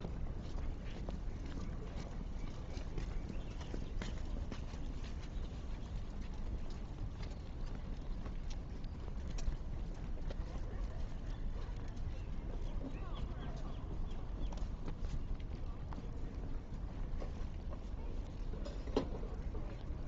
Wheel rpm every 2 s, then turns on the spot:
0, 0, 0, 0, 0, 0, 0, 0, 0, 0.
none